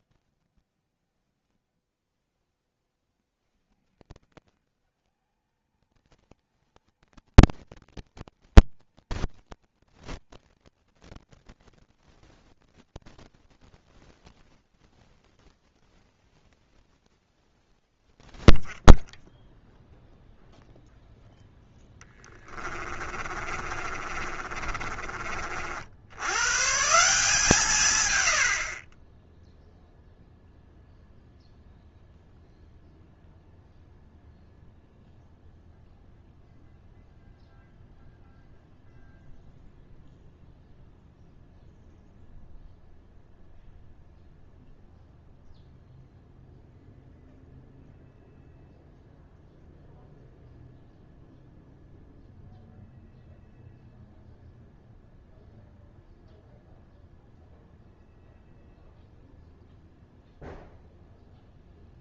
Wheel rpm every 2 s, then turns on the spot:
70, 100, 150, 170, 170, 170, 120, 120, 50, 0, 0, 30, 30, 160, 30, 0, 0, 0, 0, 0, 0, 0, 0, 0, 0, 0, 0, 0, 0, 0, 0.
0-2 16-18 22-26